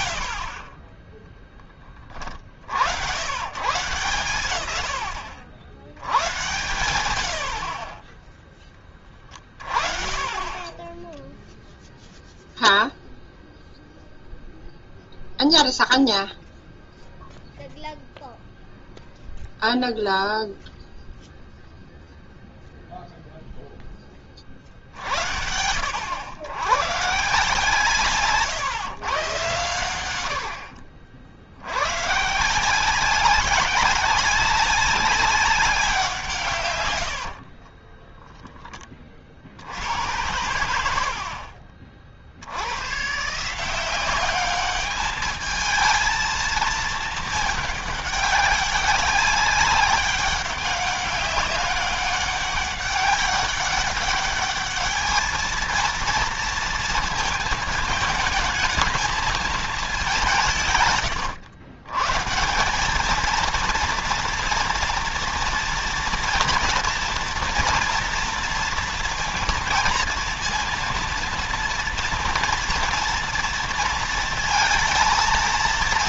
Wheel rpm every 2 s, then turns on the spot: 20, 70, 120, 100, 30, 20, 0, 0, 0, 0, 0, 0, 60, 120, 130, 70, 170, 190, 110, 30, 70, 110, 210, 220, 200, 200, 200, 210, 230, 220, 130, 200, 230, 230, 230, 230, 230, 230.
36-38 40-42